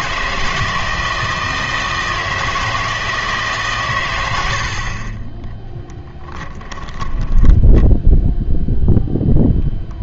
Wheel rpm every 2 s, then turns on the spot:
160, 160, 70, 10, 0.
6-8